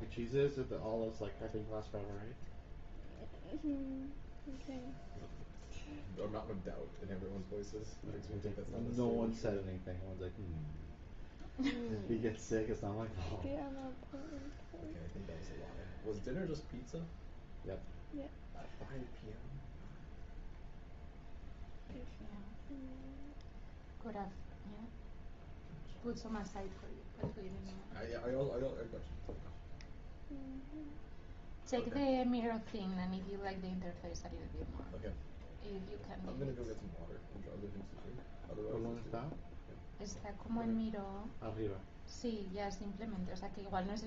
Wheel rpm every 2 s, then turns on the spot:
0, 0, 0, 0, 0, 0, 0, 0, 0, 0, 0, 0, 0, 0, 0, 0, 0, 0, 0, 0, 0, 0.
none